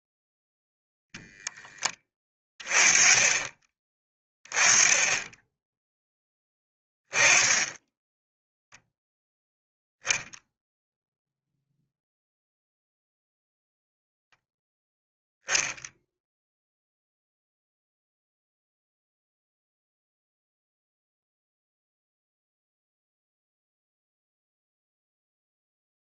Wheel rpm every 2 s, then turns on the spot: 0, 30, 10, 10, 0, 0, 0, 0, 0, 0, 0, 0, 0.
none